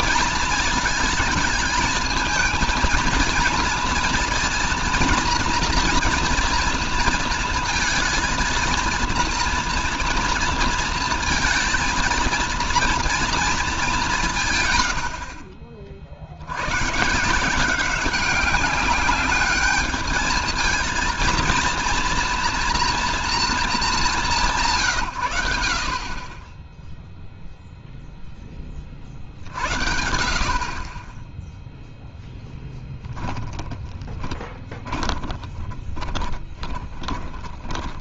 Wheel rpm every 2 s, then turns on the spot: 230, 230, 230, 230, 230, 230, 230, 140, 100, 200, 230, 230, 150, 10, 20, 30, 10, 20, 20.
32-38